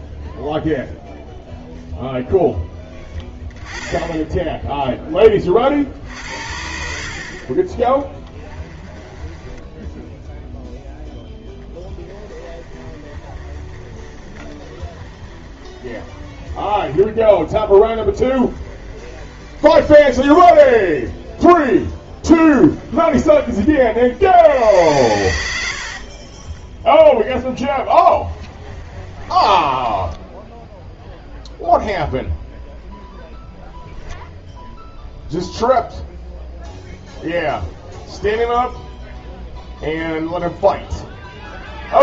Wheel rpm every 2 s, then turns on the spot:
0, 10, 0, 60, 20, 0, 20, 30, 20, 20, 20, 20, 70, 20, 20, 10, 0, 0, 0, 0, 0.
8-10 12-24 26-32